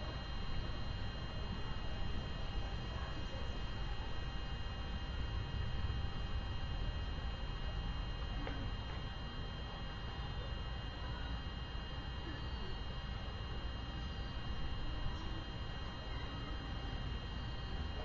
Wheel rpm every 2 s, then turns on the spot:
0, 0, 0, 0, 0, 0, 0, 0, 0.
none